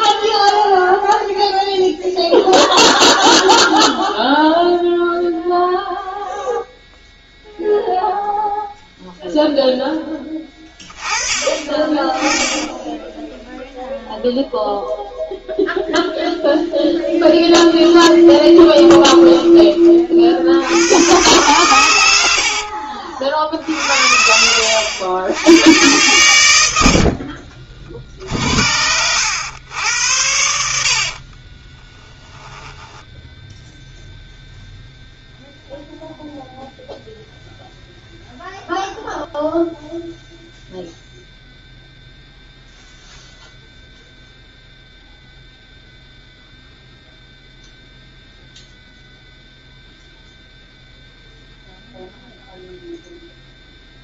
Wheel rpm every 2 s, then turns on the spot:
0, 0, 0, 0, 0, 20, 10, 0, 20, 20, 80, 60, 90, 80, 70, 80, 10, 0, 0, 0, 0, 0, 0, 0, 0, 0, 0.
12-14 16-20 22-24 32-34